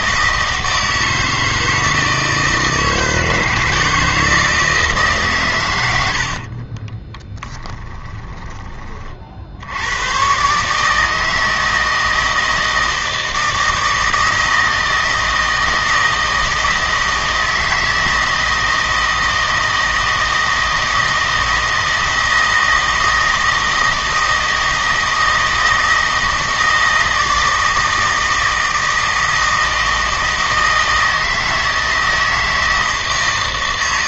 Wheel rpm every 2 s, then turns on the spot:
160, 160, 160, 30, 20, 150, 160, 160, 160, 160, 160, 160, 160, 160, 160, 160, 160.
6-8